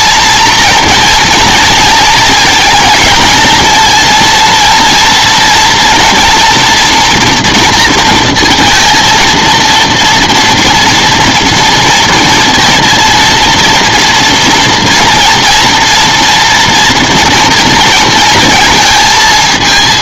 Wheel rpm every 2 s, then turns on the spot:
230, 230, 230, 240, 230, 230, 230, 230, 230, 230.
none